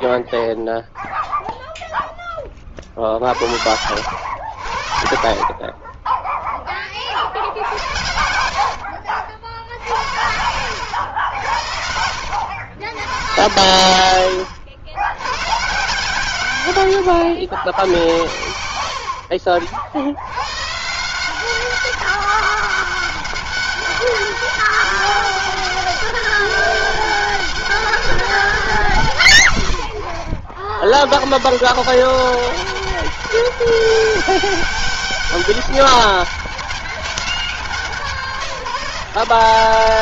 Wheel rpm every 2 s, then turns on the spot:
0, 40, 80, 30, 70, 90, 100, 90, 120, 60, 140, 200, 200, 200, 180, 100, 190, 200, 200, 180.
4-6 8-10